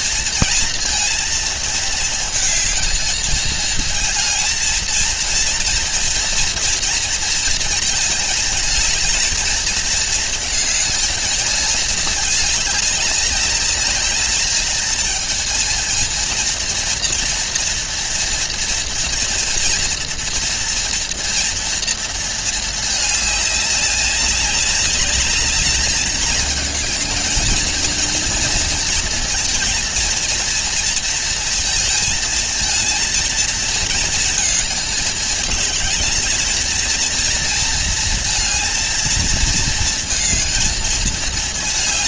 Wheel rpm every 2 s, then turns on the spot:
230, 230, 230, 230, 220, 220, 210, 220, 230, 230, 230, 220, 200, 220, 230, 230, 220, 220, 220, 230, 220.
none